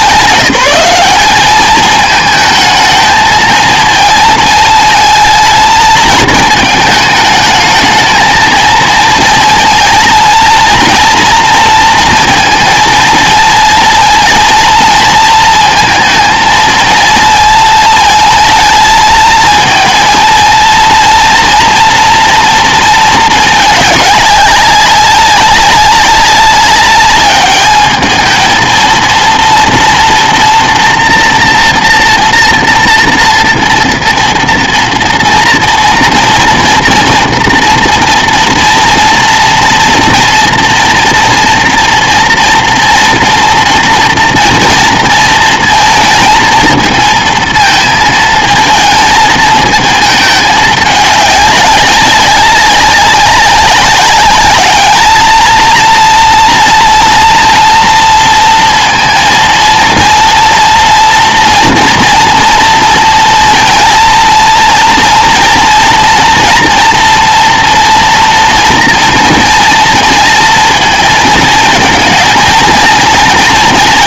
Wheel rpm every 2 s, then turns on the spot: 190, 220, 220, 210, 220, 230, 230, 230, 230, 220, 230, 230, 200, 200, 230, 240, 230, 230, 230, 240, 230, 230, 230, 230, 220, 200, 200, 210, 230, 230, 240, 230, 230, 240, 230, 220, 230.
none